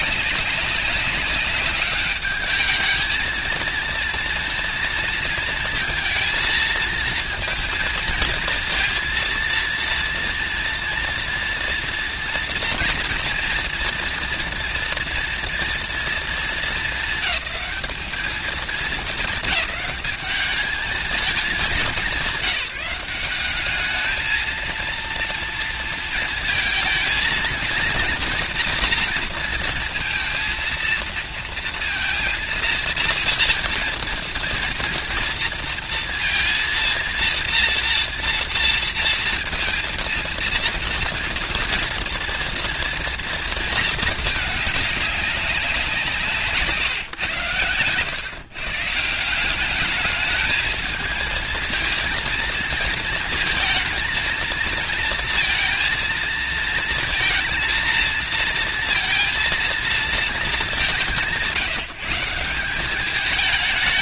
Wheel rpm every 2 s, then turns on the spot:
190, 210, 230, 230, 230, 230, 230, 230, 230, 210, 210, 190, 220, 220, 230, 230, 230, 230, 230, 240, 230, 230, 210, 150, 130, 210, 230, 230, 230, 230, 220, 170.
none